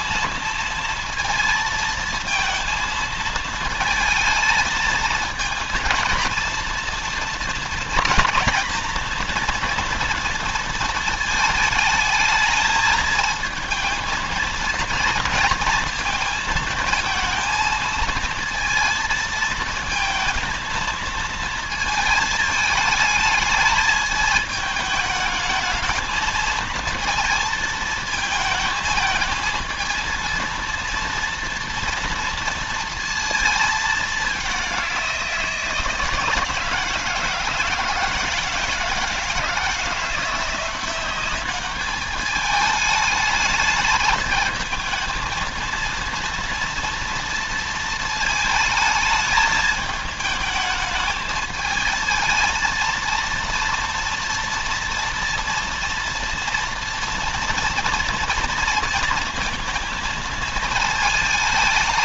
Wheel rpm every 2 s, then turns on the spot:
230, 220, 230, 230, 230, 230, 220, 230, 230, 230, 230, 220, 210, 230, 220, 230, 230, 180, 160, 160, 190, 210, 220, 230, 220, 220, 230, 230, 240, 230, 220.
none